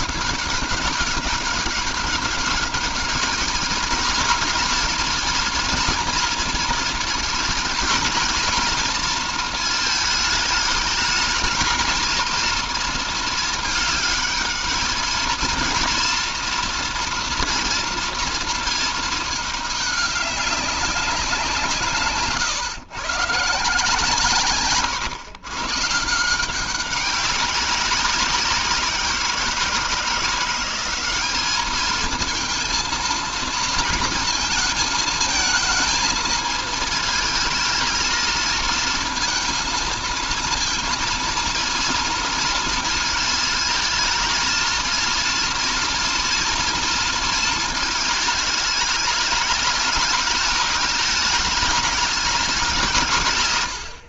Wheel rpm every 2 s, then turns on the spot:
200, 210, 230, 230, 230, 210, 220, 220, 240, 220, 190, 140, 120, 190, 180, 190, 230, 220, 220, 220, 230, 230, 230, 230, 210, 210, 160.
none